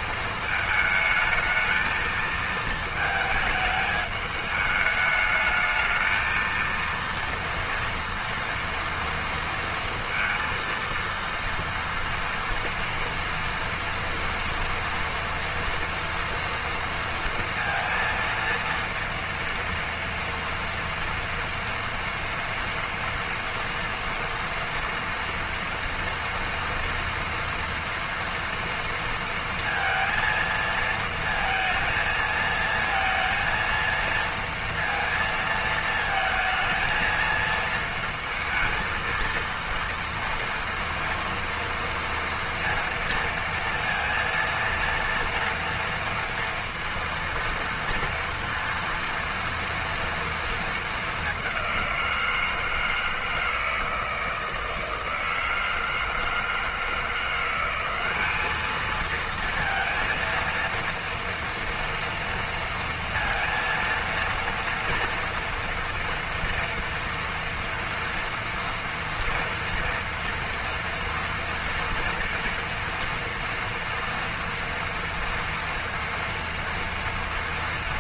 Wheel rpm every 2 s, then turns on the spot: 220, 220, 210, 230, 230, 230, 230, 230, 230, 230, 230, 230, 230, 230, 230, 230, 230, 230, 230, 230, 230, 230, 230, 230, 230, 220, 160, 160, 160, 210, 230, 230, 230, 230, 240, 230, 230, 230, 230.
none